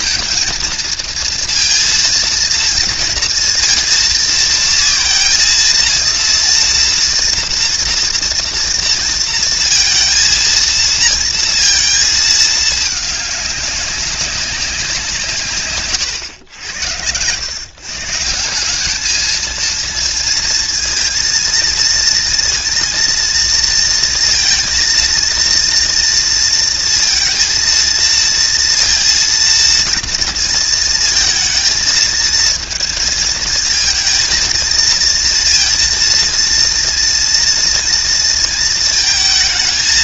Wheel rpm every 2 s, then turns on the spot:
230, 230, 230, 230, 230, 230, 220, 190, 90, 160, 230, 230, 230, 230, 230, 230, 230, 230, 230, 230.
none